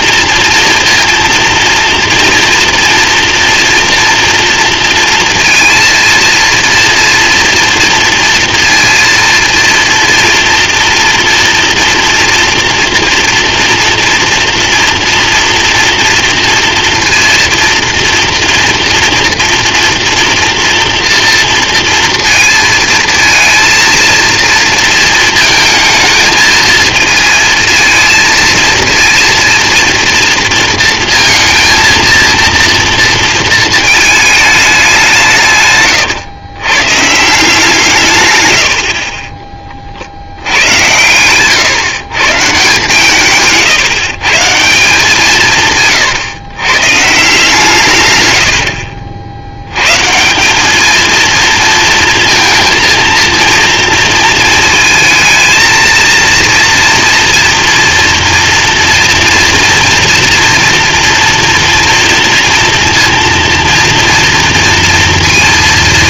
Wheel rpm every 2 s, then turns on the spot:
230, 240, 230, 230, 230, 230, 230, 230, 230, 230, 230, 230, 230, 220, 230, 230, 230, 210, 120, 110, 90, 150, 160, 130, 80, 200, 230, 230, 230, 230, 230, 230, 230.
none